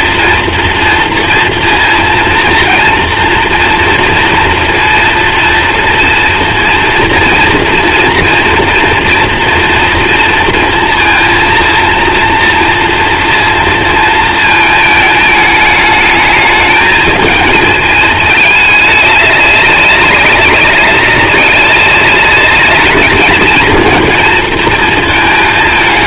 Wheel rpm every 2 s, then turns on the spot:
230, 230, 230, 230, 230, 230, 240, 220, 220, 210, 200, 210, 230.
none